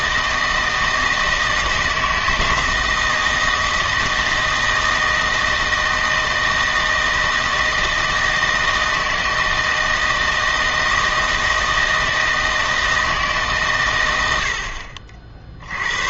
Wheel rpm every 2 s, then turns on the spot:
160, 160, 160, 160, 160, 160, 160, 70.
none